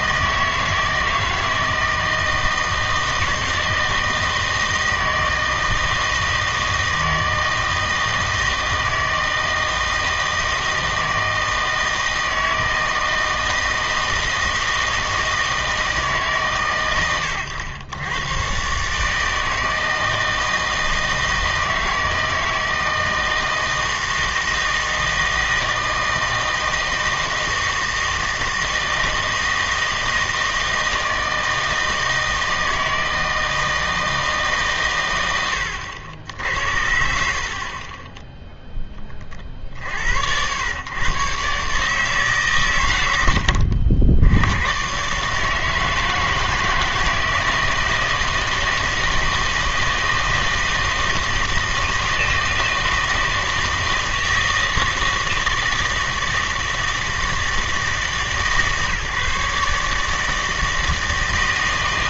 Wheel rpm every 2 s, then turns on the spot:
160, 160, 160, 160, 160, 160, 160, 160, 140, 130, 160, 160, 160, 160, 160, 160, 160, 140, 80, 0, 100, 130, 110, 160, 160, 160, 160, 160, 160, 150, 160.
none